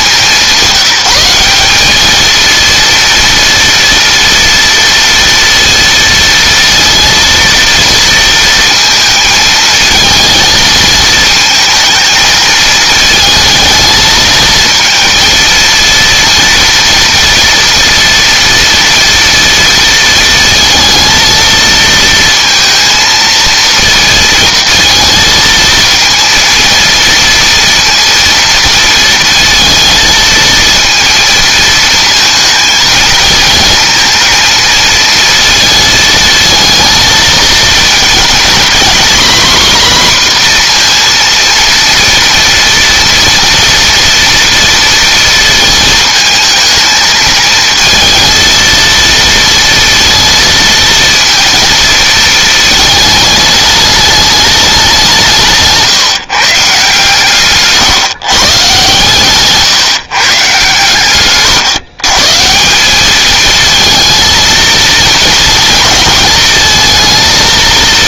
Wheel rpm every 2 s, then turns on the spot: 190, 230, 230, 230, 220, 220, 220, 230, 230, 230, 230, 230, 230, 230, 230, 230, 220, 230, 230, 230, 240, 230, 230, 220, 230, 230, 220, 190, 150, 130, 130, 200, 230, 220.
none